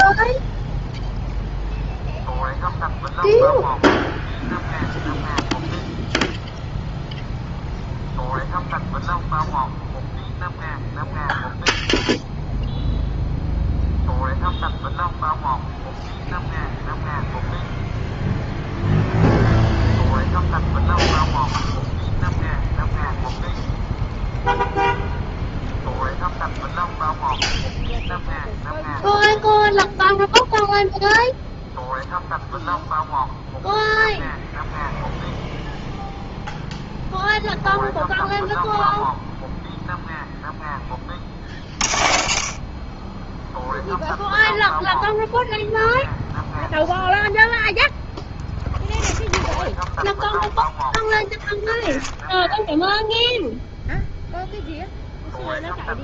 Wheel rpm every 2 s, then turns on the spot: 0, 0, 0, 0, 0, 0, 0, 0, 0, 0, 0, 0, 0, 0, 0, 0, 0, 0, 0, 0, 10, 30, 0, 0, 0, 0, 0, 0.
none